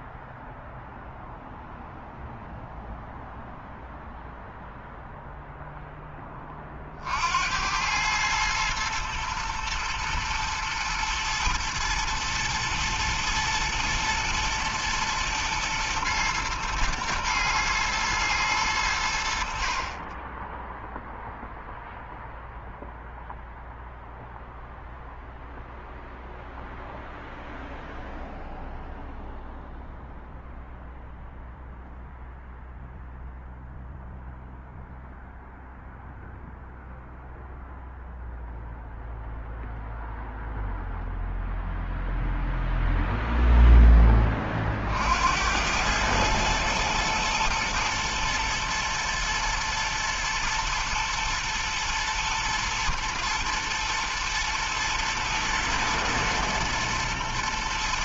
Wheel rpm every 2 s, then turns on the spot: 0, 0, 0, 60, 110, 110, 120, 110, 110, 80, 0, 0, 0, 0, 0, 0, 0, 0, 0, 0, 0, 0, 70, 110, 110, 120, 110, 120, 120.
none